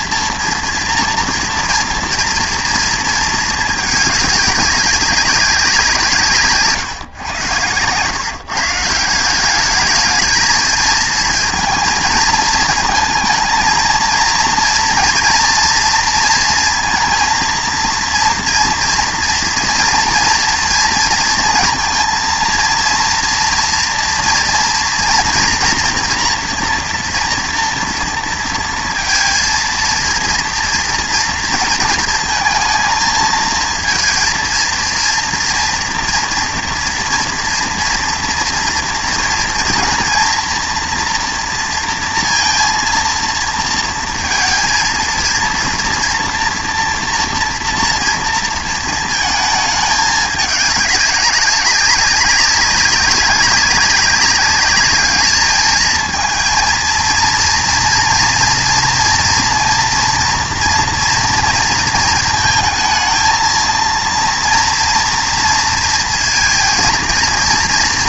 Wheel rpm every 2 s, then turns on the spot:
230, 230, 200, 140, 150, 220, 220, 230, 230, 230, 230, 230, 240, 240, 230, 230, 220, 230, 230, 230, 230, 230, 230, 230, 230, 210, 200, 200, 220, 230, 230, 230, 230, 230.
none